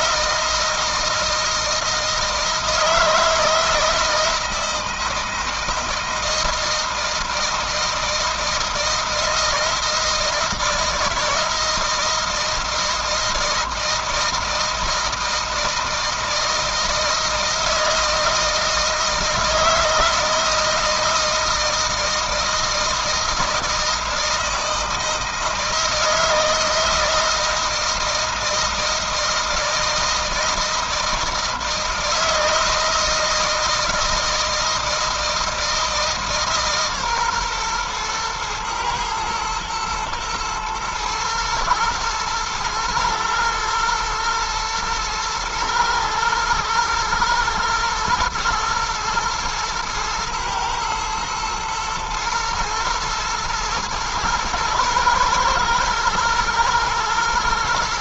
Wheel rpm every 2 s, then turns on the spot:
160, 160, 160, 160, 160, 160, 160, 160, 160, 160, 160, 160, 160, 160, 160, 160, 160, 160, 140, 120, 110, 110, 120, 110, 120, 110, 110, 110, 110.
none